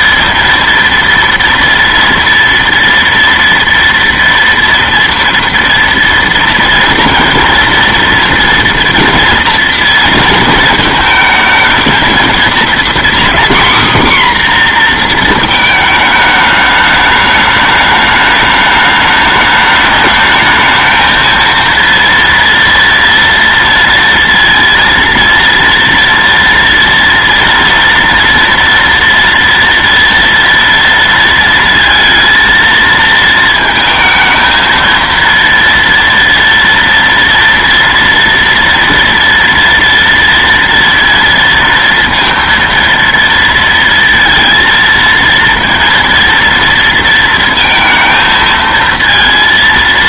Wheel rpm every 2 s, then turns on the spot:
230, 230, 230, 230, 230, 230, 230, 260, 210, 210, 210, 230, 230, 230, 230, 230, 230, 220, 230, 230, 230, 230, 230, 230, 220.
none